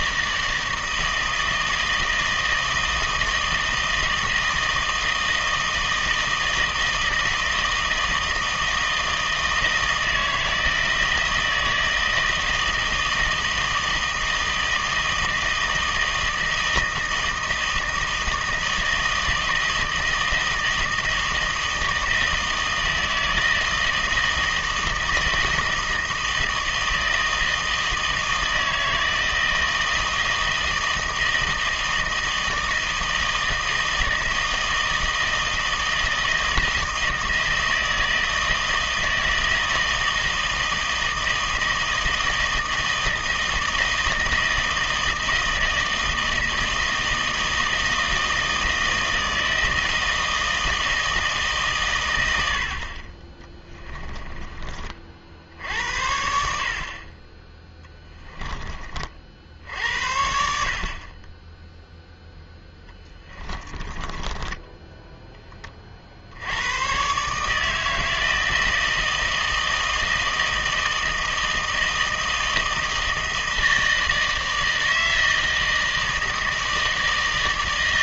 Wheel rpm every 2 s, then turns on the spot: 160, 160, 160, 160, 160, 160, 160, 160, 160, 160, 160, 160, 160, 160, 160, 160, 160, 160, 160, 160, 160, 160, 160, 160, 160, 160, 60, 40, 40, 30, 40, 10, 10, 100, 160, 160, 160, 160, 160.
62-66